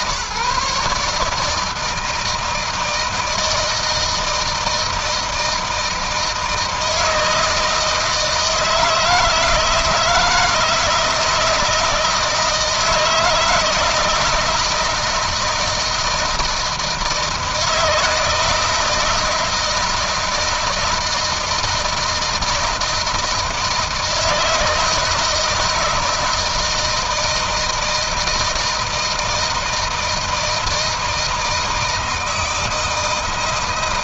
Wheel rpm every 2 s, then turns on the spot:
140, 160, 160, 160, 160, 160, 160, 160, 160, 160, 160, 160, 160, 160, 160, 160, 160.
none